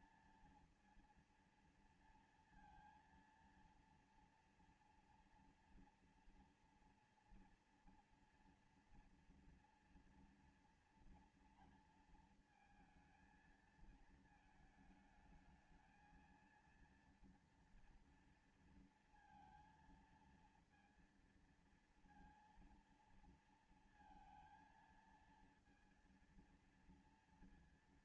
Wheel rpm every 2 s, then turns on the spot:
230, 230, 230, 230, 230, 230, 220, 220, 230, 230, 230, 230, 230, 230.
none